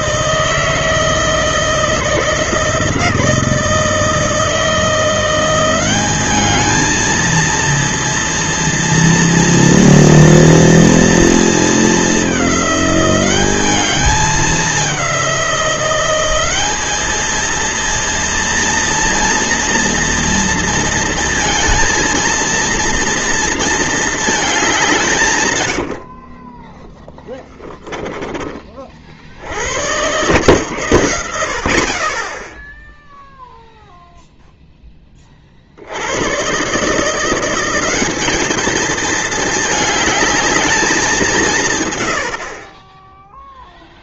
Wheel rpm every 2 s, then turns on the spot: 160, 160, 160, 210, 230, 230, 200, 210, 200, 230, 230, 230, 210, 40, 40, 130, 0, 0, 120, 210, 210, 30.
none